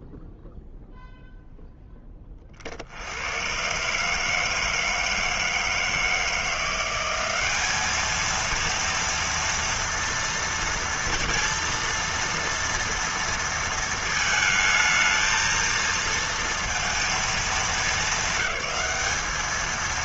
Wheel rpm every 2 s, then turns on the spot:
0, 30, 150, 170, 220, 230, 230, 220, 230, 200.
none